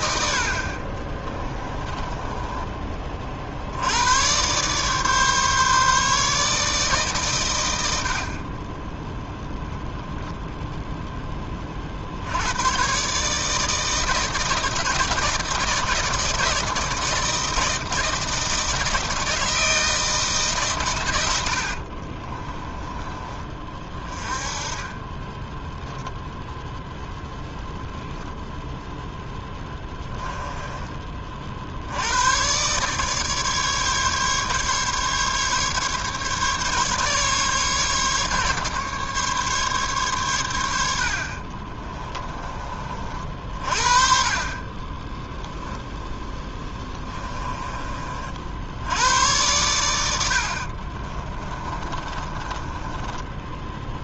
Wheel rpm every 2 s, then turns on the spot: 40, 20, 140, 150, 20, 0, 120, 160, 160, 160, 130, 20, 20, 0, 0, 20, 130, 140, 140, 140, 70, 30, 20, 10, 70, 60, 20.
22-24 46-48 50-54